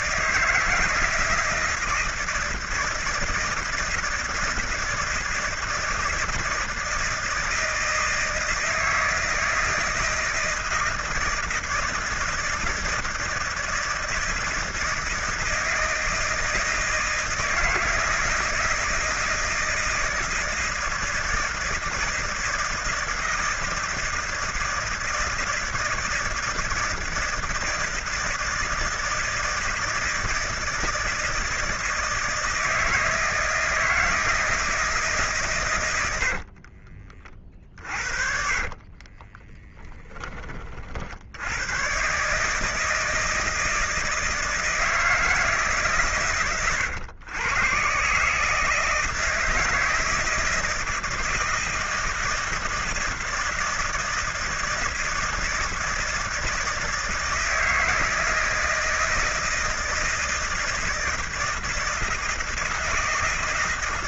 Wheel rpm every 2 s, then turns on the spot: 160, 160, 160, 160, 160, 160, 160, 160, 160, 160, 160, 160, 160, 160, 160, 160, 160, 160, 50, 40, 30, 150, 160, 130, 160, 160, 160, 160, 160, 160, 160, 160.
36-40